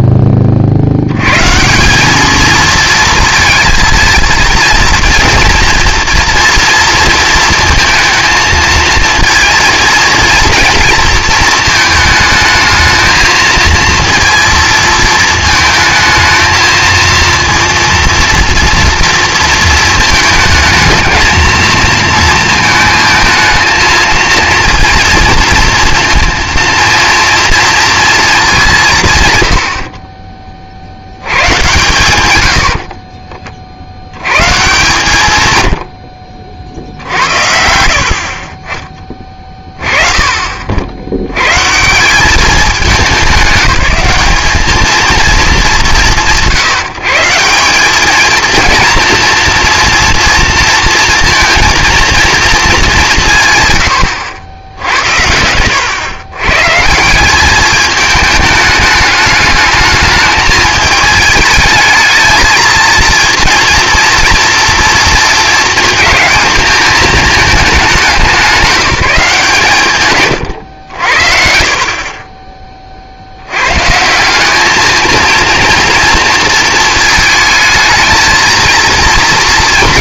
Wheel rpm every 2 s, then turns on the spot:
110, 230, 230, 230, 230, 230, 220, 220, 230, 230, 220, 230, 230, 240, 120, 80, 30, 140, 60, 20, 70, 200, 210, 150, 230, 230, 220, 70, 140, 210, 220, 230, 230, 220, 190, 90, 30, 210, 230, 230.
32-34 36-38